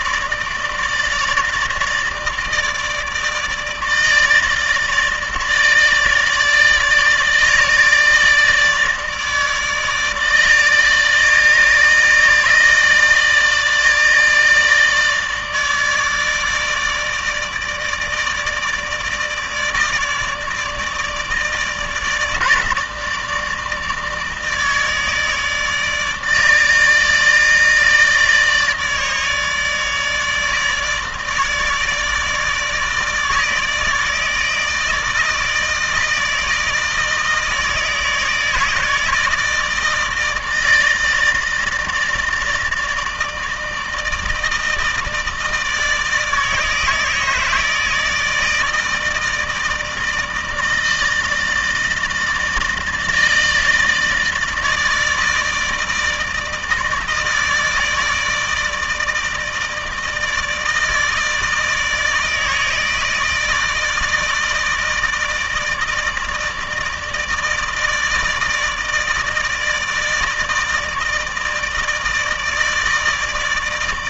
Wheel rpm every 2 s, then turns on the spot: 150, 150, 150, 150, 160, 150, 160, 160, 160, 150, 150, 150, 150, 150, 150, 150, 160, 160, 160, 160, 160, 160, 160, 160, 160, 160, 160, 160, 160, 160, 160, 160, 160, 160, 160, 160, 160.
none